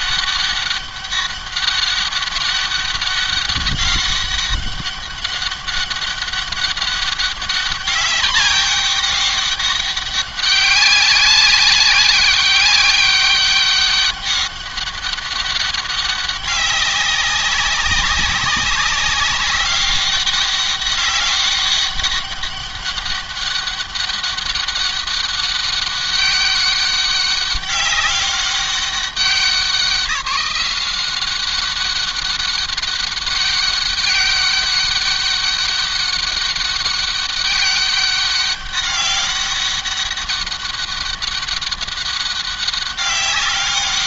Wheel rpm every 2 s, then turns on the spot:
200, 200, 200, 200, 200, 200, 200, 200, 200, 190, 200, 200, 200, 200, 200, 190, 200, 200, 200, 200, 200, 200.
none